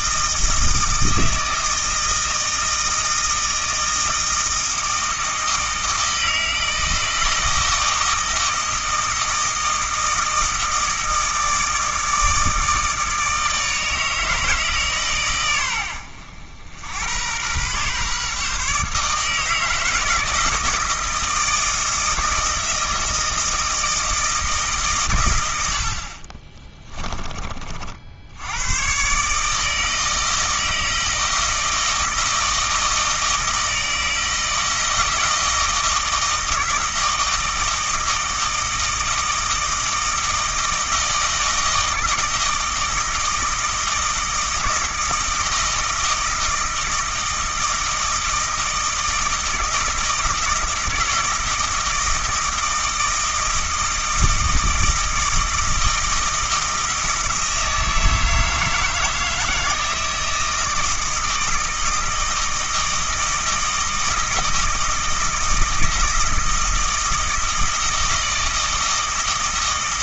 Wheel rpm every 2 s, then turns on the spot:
160, 160, 160, 160, 160, 160, 160, 140, 90, 150, 160, 160, 130, 20, 120, 160, 160, 160, 160, 160, 160, 160, 160, 160, 160, 160, 160, 160, 160, 160, 160, 160, 160, 160, 160.
26-28